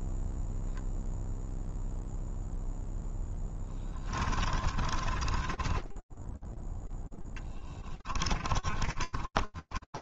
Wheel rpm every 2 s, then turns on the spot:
0, 0, 20, 0, 30.
4-6 8-10